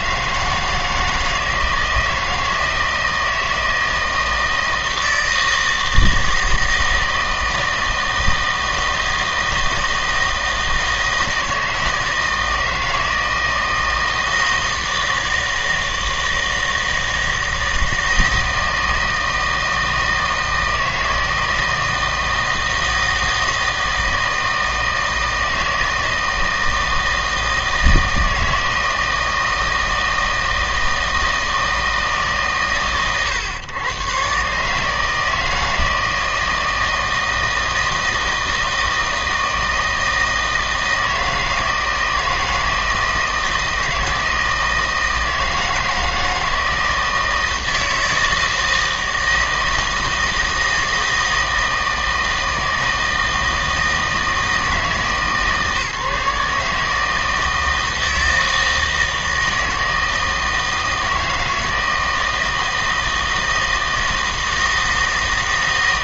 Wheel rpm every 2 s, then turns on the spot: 160, 160, 160, 160, 160, 160, 160, 160, 160, 160, 160, 160, 160, 160, 160, 160, 130, 150, 160, 160, 160, 160, 160, 160, 160, 160, 160, 160, 150, 160, 160, 160, 160.
none